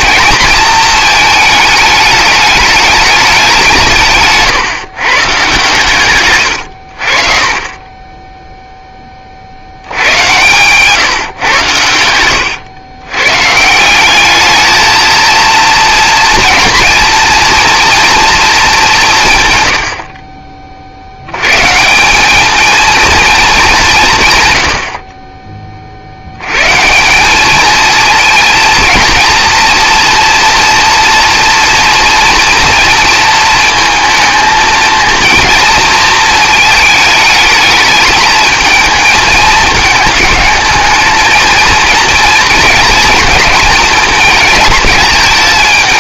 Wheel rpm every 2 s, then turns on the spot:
220, 210, 150, 90, 10, 130, 90, 220, 240, 200, 40, 220, 90, 140, 230, 230, 230, 230, 220, 220, 220, 230, 210.
none